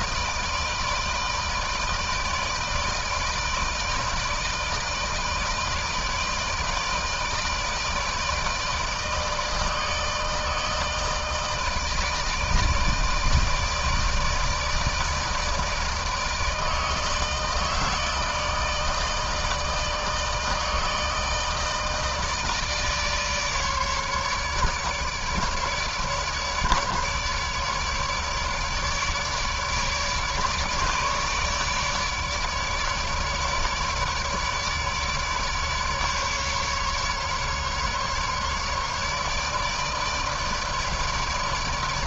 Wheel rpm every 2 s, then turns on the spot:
160, 160, 160, 160, 160, 160, 160, 160, 160, 150, 160, 160, 150, 150, 150, 150, 150, 150, 140, 150, 150.
none